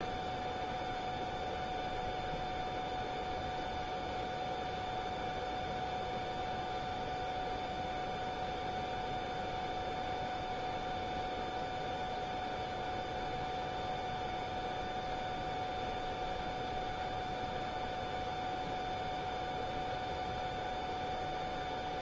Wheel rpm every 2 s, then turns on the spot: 0, 0, 0, 0, 0, 0, 0, 0, 0, 0, 0.
none